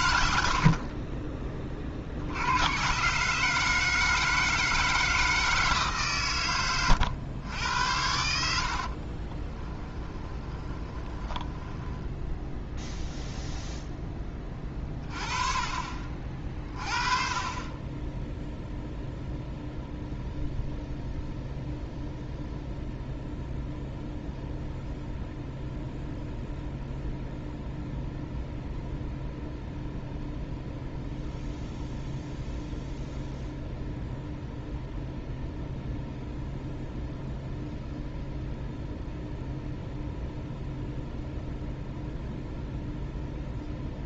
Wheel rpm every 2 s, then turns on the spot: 40, 120, 160, 110, 60, 20, 0, 30, 30, 0, 0, 0, 0, 0, 0, 0, 0, 0, 0, 0, 0, 0.
8-12